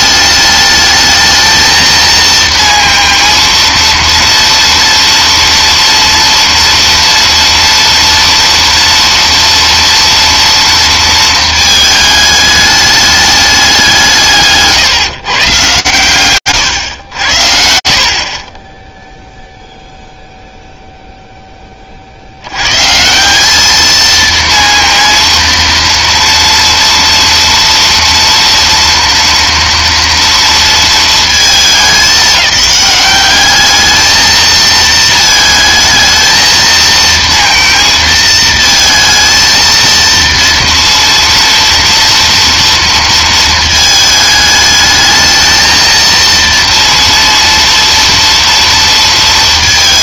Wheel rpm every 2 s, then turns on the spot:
210, 230, 230, 230, 230, 230, 210, 150, 120, 20, 0, 160, 230, 230, 230, 230, 200, 220, 230, 230, 230, 230, 220, 230, 230.
none